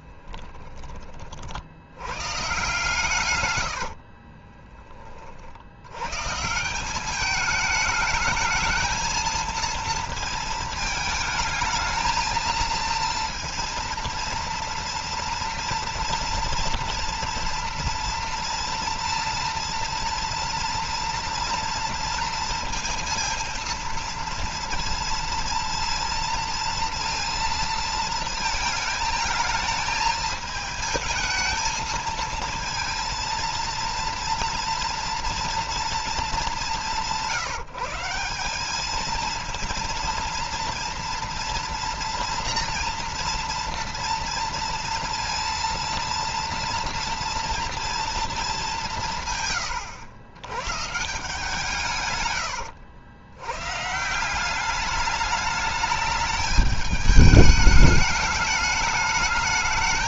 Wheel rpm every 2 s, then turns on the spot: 30, 140, 30, 170, 220, 220, 230, 230, 230, 230, 230, 230, 230, 230, 220, 220, 230, 230, 160, 210, 230, 230, 230, 230, 170, 140, 100, 200, 210, 210.
none